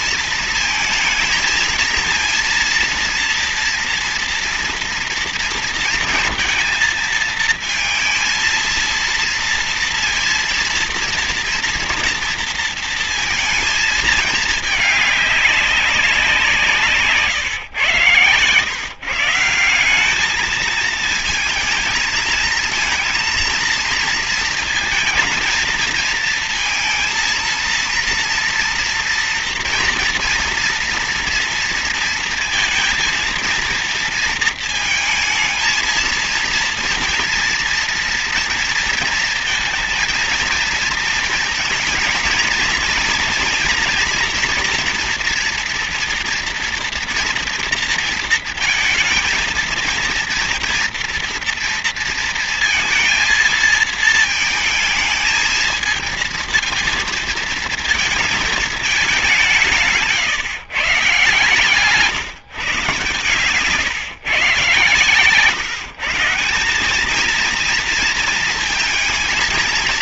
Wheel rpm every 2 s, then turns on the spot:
230, 230, 230, 220, 220, 230, 230, 220, 170, 130, 210, 220, 230, 220, 230, 230, 230, 230, 230, 230, 230, 230, 240, 240, 230, 230, 230, 220, 230, 220, 140, 140, 130, 170, 230.
none